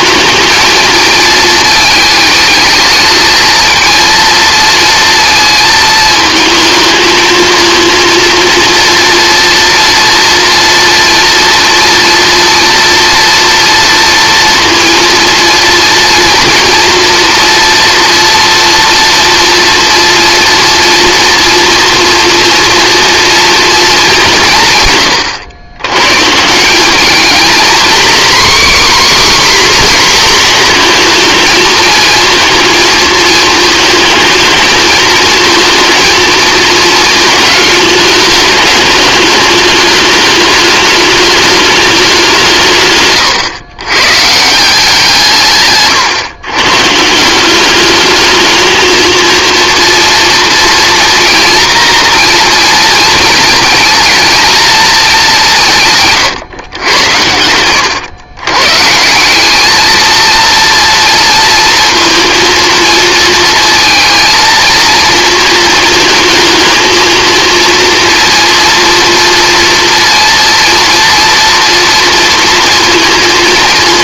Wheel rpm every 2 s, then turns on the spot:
230, 220, 230, 220, 230, 230, 230, 230, 240, 230, 230, 230, 150, 180, 280, 240, 220, 220, 230, 210, 210, 150, 160, 130, 220, 240, 230, 230, 100, 130, 230, 230, 230, 220, 230, 230, 230.
none